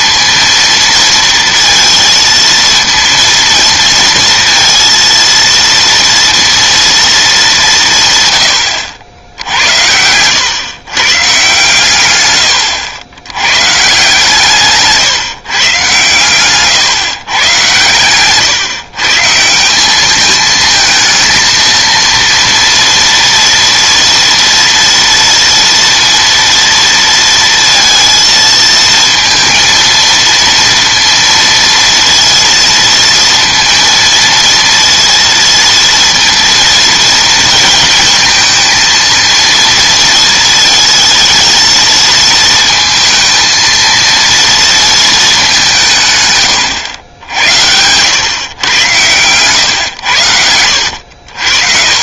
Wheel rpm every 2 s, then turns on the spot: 230, 230, 230, 230, 100, 110, 90, 150, 130, 140, 220, 230, 230, 230, 230, 230, 230, 230, 230, 230, 230, 230, 230, 110, 110, 80.
none